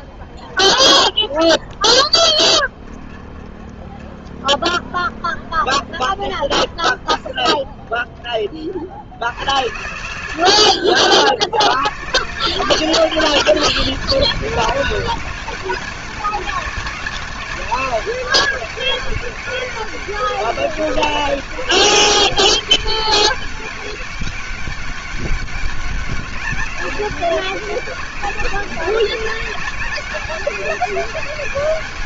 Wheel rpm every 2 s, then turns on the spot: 20, 30, 20, 10, 60, 60, 180, 200, 190, 190, 200, 200, 190, 200, 190, 200.
none